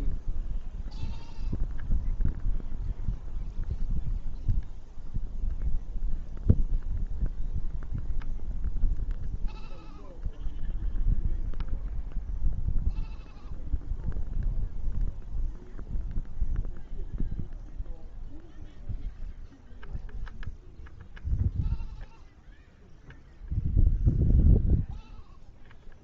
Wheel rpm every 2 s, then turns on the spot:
0, 0, 0, 0, 0, 0, 0, 0, 0, 0, 0, 0, 0.
none